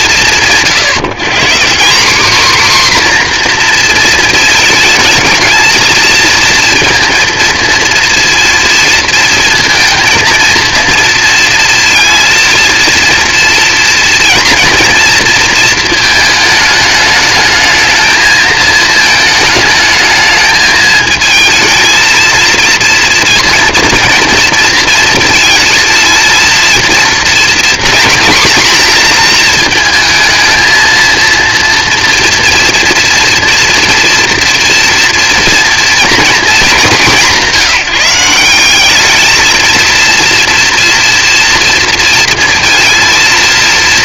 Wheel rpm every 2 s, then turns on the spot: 180, 250, 220, 230, 230, 230, 230, 230, 210, 220, 220, 230, 230, 230, 230, 230, 240, 240, 190, 220, 230, 230.
none